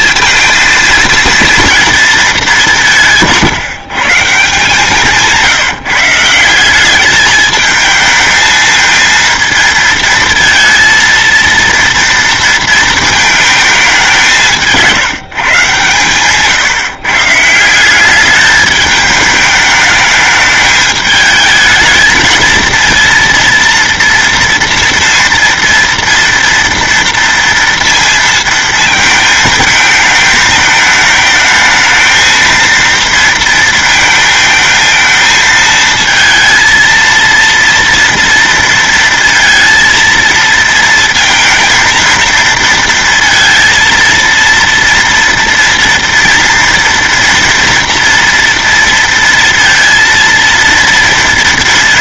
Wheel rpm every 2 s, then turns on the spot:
220, 200, 170, 180, 220, 230, 230, 190, 140, 210, 210, 230, 230, 230, 230, 220, 230, 220, 230, 230, 230, 230, 230, 230, 230, 230.
none